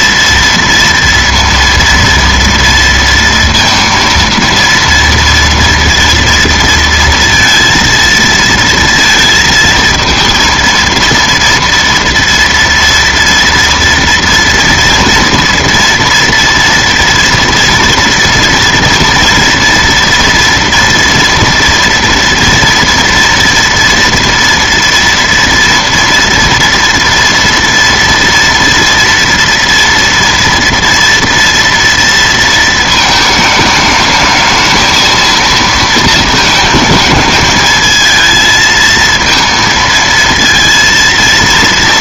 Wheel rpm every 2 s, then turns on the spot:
230, 230, 230, 230, 230, 230, 230, 230, 230, 230, 230, 230, 230, 240, 230, 230, 230, 220, 220, 220, 230.
none